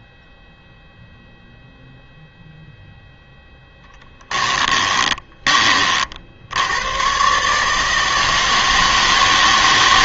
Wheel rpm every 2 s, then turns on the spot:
0, 0, 20, 120, 160.
4-6